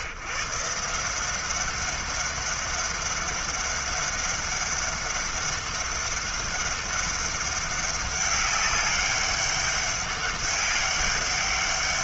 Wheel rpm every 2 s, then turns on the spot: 160, 200, 200, 200, 200, 200.
none